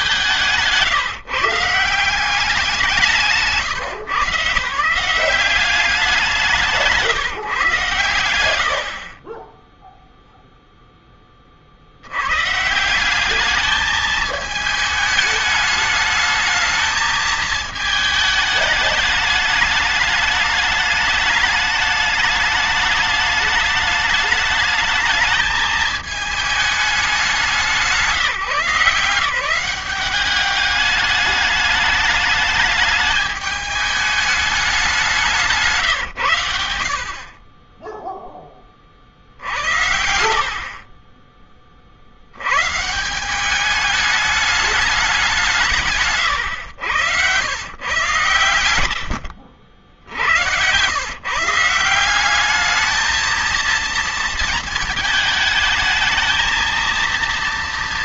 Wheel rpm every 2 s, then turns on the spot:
140, 190, 140, 140, 60, 0, 160, 220, 220, 210, 210, 210, 220, 220, 170, 200, 210, 190, 60, 30, 40, 150, 200, 100, 100, 100, 220, 220, 230.
46-48